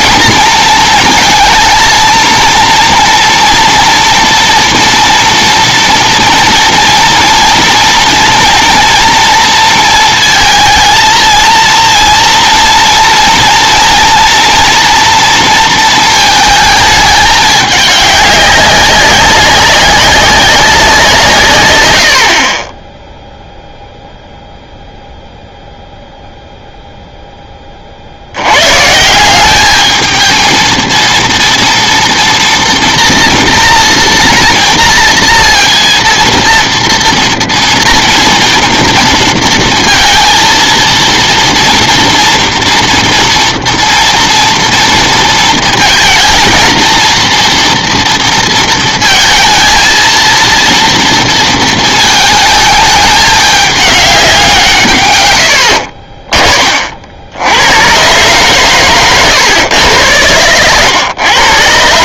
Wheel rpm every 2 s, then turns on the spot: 230, 230, 240, 230, 230, 230, 230, 230, 220, 200, 190, 20, 0, 0, 130, 230, 230, 230, 230, 230, 230, 240, 230, 230, 230, 230, 220, 160, 30, 130, 100.
none